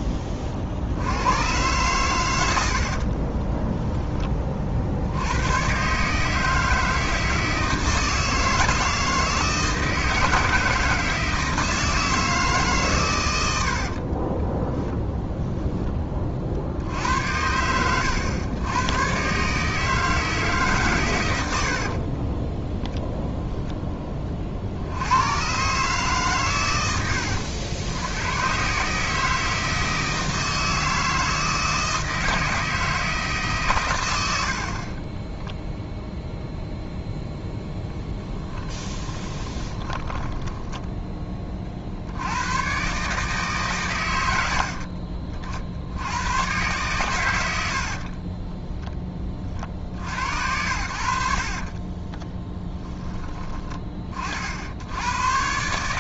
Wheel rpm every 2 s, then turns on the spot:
40, 70, 60, 160, 160, 160, 130, 10, 70, 110, 140, 10, 80, 110, 140, 160, 160, 40, 0, 20, 10, 120, 50, 120, 10, 70, 20, 80.
2-4 14-16 22-24 34-36 38-40